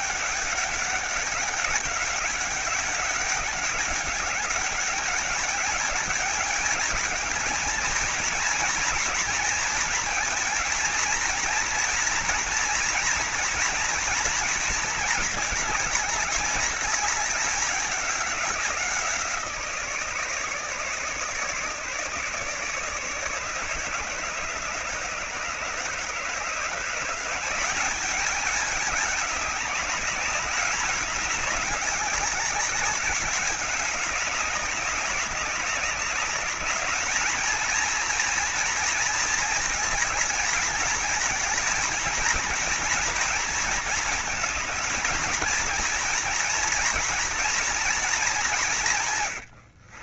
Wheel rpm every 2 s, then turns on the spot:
200, 200, 200, 220, 230, 230, 230, 220, 210, 170, 150, 150, 150, 170, 210, 200, 190, 200, 220, 230, 220, 230, 230, 230, 140.
48-50